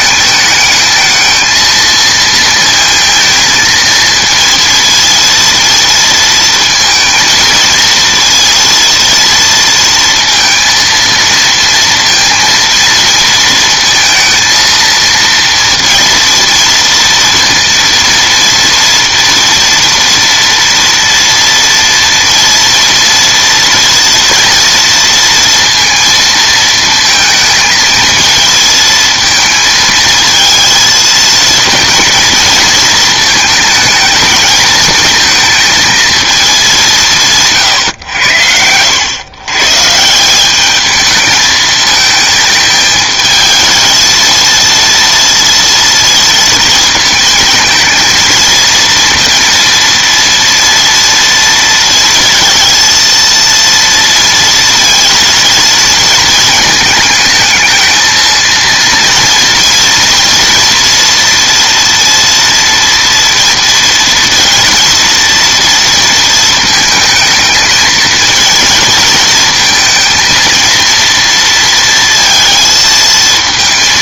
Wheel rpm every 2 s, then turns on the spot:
210, 230, 230, 230, 230, 230, 230, 230, 230, 230, 230, 230, 230, 220, 230, 230, 230, 220, 210, 90, 210, 220, 230, 220, 230, 230, 230, 230, 220, 230, 230, 230, 230, 220, 230, 230, 230.
none